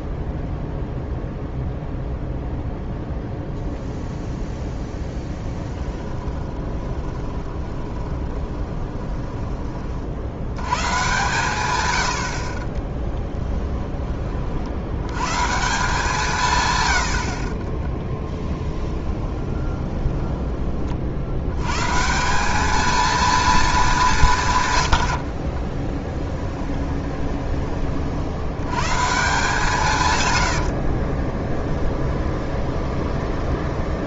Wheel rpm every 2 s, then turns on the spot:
0, 0, 0, 20, 20, 110, 20, 60, 130, 10, 30, 210, 130, 10, 100, 80, 20.
6-10 12-14 18-20 26-28 30-34